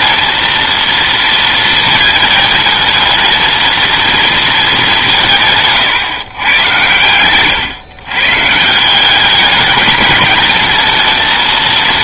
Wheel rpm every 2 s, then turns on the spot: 230, 220, 200, 120, 160, 210.
none